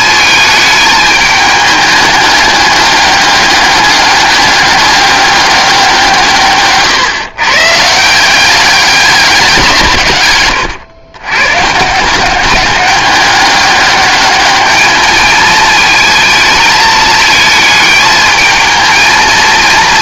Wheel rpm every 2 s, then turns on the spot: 220, 210, 200, 130, 190, 110, 190, 210, 220, 220.
none